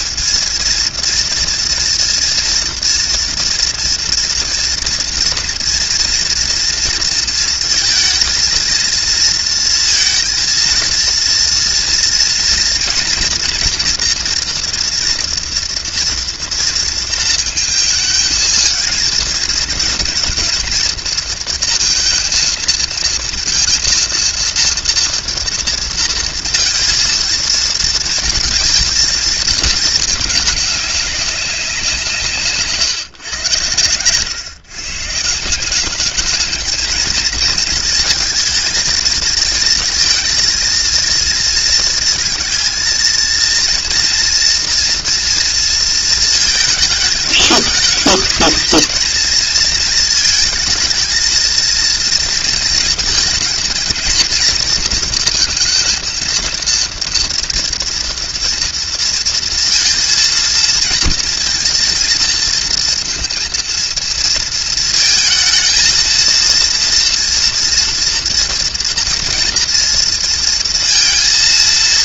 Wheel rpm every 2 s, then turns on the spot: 230, 230, 230, 230, 230, 230, 230, 230, 230, 220, 230, 230, 230, 230, 220, 200, 140, 130, 220, 230, 230, 230, 240, 220, 230, 230, 220, 230, 230, 230, 230, 230, 230, 230, 240, 230.
none